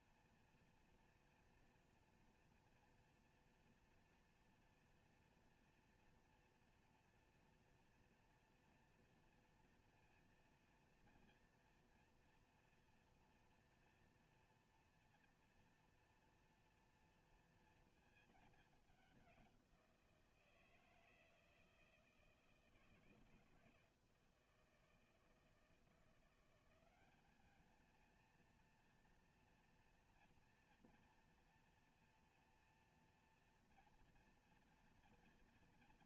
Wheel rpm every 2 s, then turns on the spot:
240, 230, 230, 230, 230, 230, 230, 230, 230, 190, 160, 160, 160, 200, 230, 230, 230, 240.
none